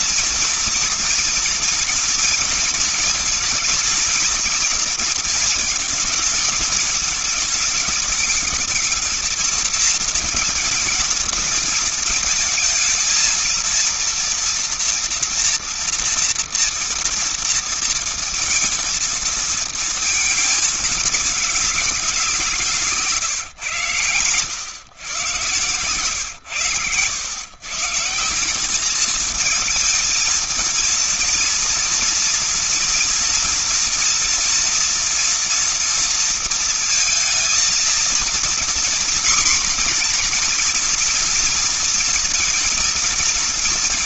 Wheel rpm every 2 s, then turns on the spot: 230, 230, 230, 220, 220, 230, 220, 230, 240, 230, 230, 190, 120, 120, 170, 220, 230, 230, 230, 230, 230, 230.
none